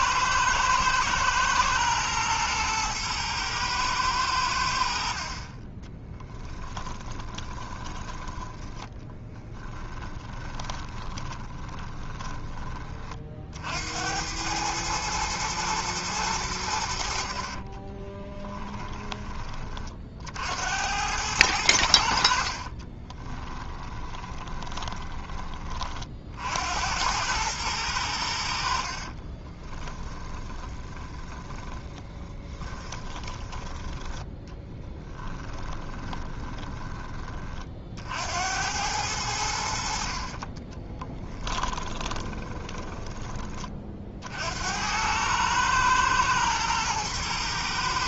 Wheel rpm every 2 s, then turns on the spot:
110, 110, 60, 20, 10, 20, 30, 110, 70, 20, 90, 30, 10, 80, 50, 20, 20, 20, 10, 90, 40, 20, 90, 110.
6-8 10-12 18-20 22-26 28-36 40-44